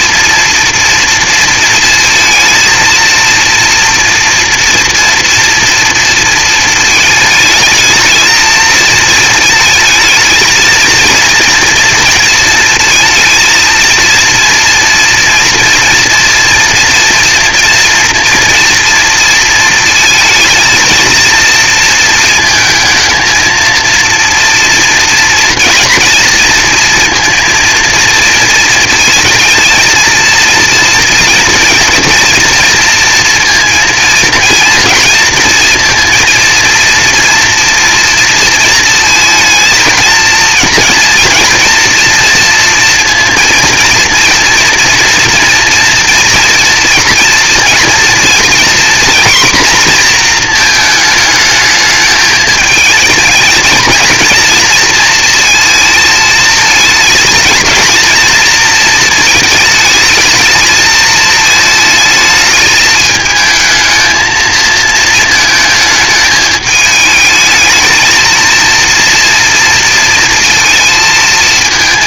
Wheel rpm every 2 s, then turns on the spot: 230, 230, 230, 220, 230, 230, 220, 230, 240, 230, 230, 220, 230, 230, 230, 230, 230, 230, 230, 230, 230, 230, 230, 240, 240, 230, 220, 230, 220, 230, 220, 210, 220, 220, 230, 230.
none